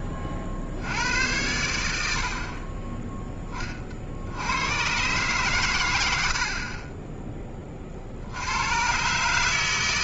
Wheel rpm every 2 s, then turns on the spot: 70, 10, 110, 10, 140.
none